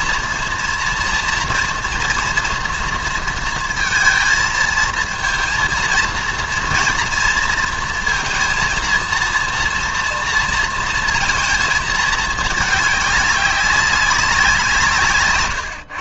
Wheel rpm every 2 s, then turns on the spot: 230, 240, 220, 230, 230, 230, 210, 180.
none